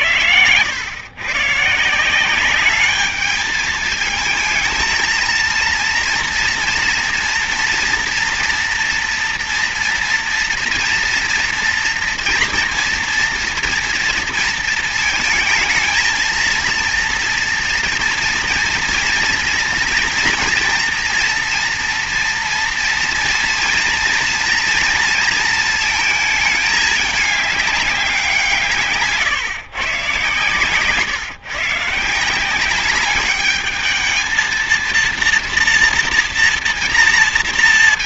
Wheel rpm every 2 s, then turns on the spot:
120, 180, 220, 230, 230, 230, 230, 230, 230, 230, 230, 230, 230, 220, 170, 130, 170, 220, 230.
none